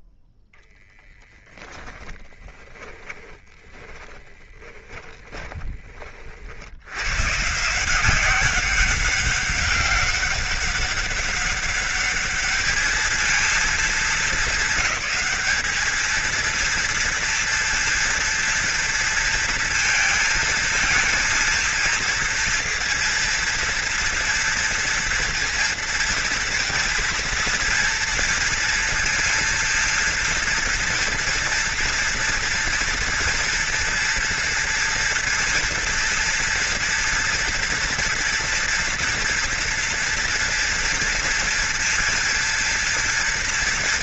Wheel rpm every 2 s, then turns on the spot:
10, 20, 10, 60, 190, 200, 210, 220, 220, 230, 220, 230, 230, 230, 230, 230, 230, 230, 230, 240, 230, 230.
2-6